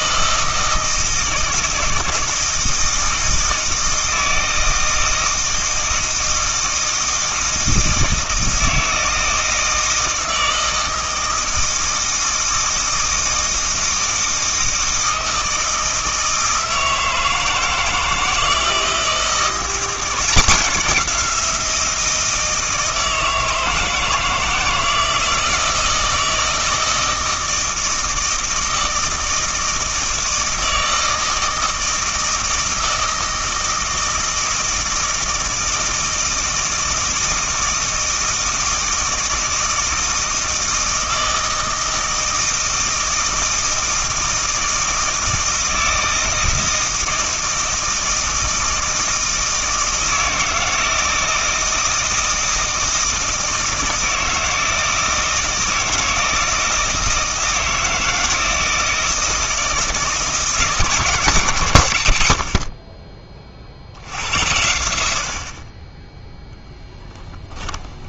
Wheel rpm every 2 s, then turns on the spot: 160, 160, 160, 160, 160, 160, 160, 160, 160, 160, 190, 160, 160, 160, 160, 160, 160, 160, 160, 160, 160, 160, 160, 160, 160, 160, 160, 160, 160, 160, 150, 50, 80, 10.
66-68